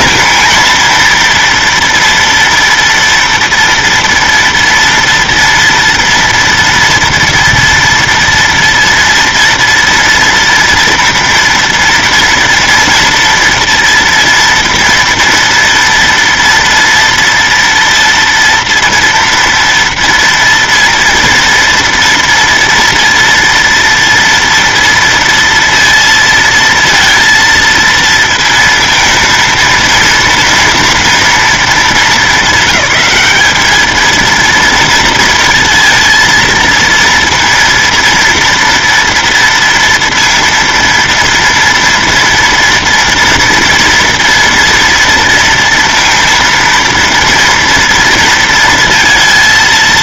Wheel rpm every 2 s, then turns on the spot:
230, 230, 230, 230, 230, 230, 230, 230, 230, 230, 240, 230, 230, 230, 230, 230, 200, 230, 230, 230, 230, 230, 230, 230, 230.
none